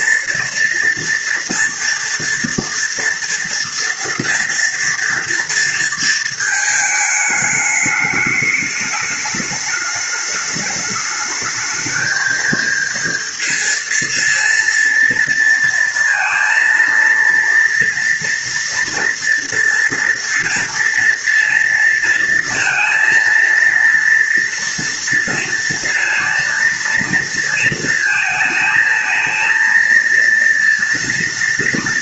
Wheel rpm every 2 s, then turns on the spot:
230, 230, 230, 230, 210, 210, 220, 230, 230, 230, 230, 230, 230, 230, 220, 230.
none